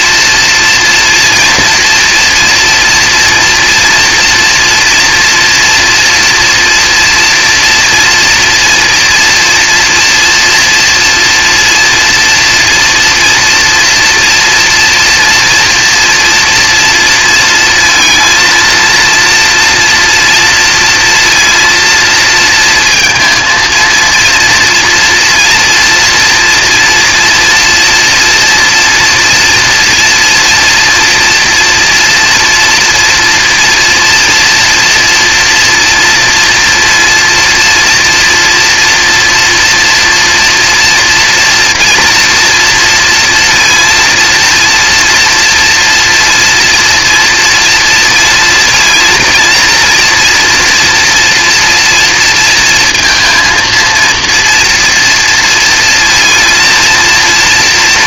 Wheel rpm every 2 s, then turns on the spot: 230, 230, 230, 230, 230, 230, 240, 230, 240, 230, 230, 230, 230, 240, 230, 230, 230, 230, 230, 240, 230, 230, 230, 230, 230, 230, 230, 230, 230.
none